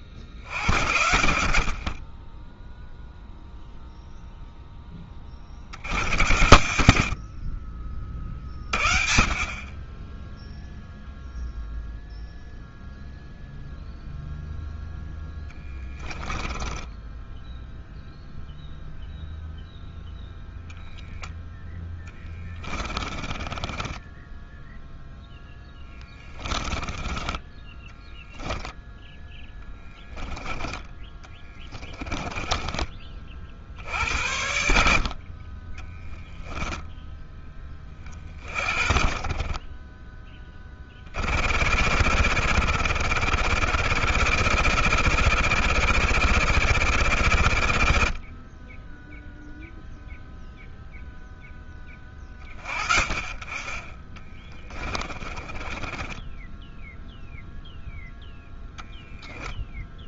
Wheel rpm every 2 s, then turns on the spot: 50, 0, 10, 80, 40, 0, 0, 0, 10, 0, 10, 20, 10, 10, 0, 10, 10, 60, 10, 40, 20, 90, 100, 110, 30, 0, 30, 20, 10, 0.
16-18 22-28 54-56